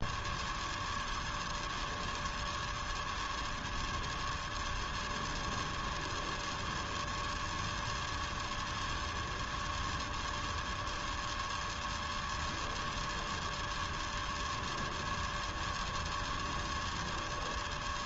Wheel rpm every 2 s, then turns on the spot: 0, 0, 0, 0, 0, 0, 0, 0, 0.
none